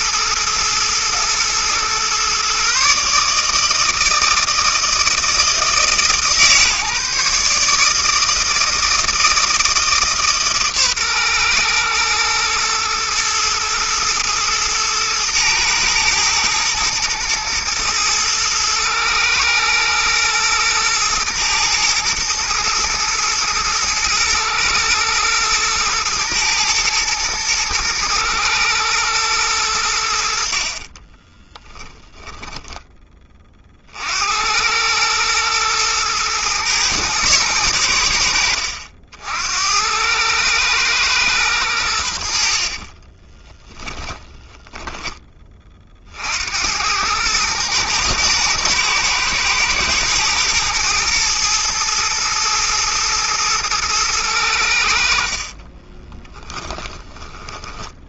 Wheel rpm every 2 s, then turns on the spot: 120, 150, 160, 150, 160, 120, 110, 110, 120, 120, 110, 110, 110, 110, 110, 20, 20, 110, 110, 70, 110, 20, 10, 100, 110, 110, 110, 70, 20.
30-32 42-44 56-58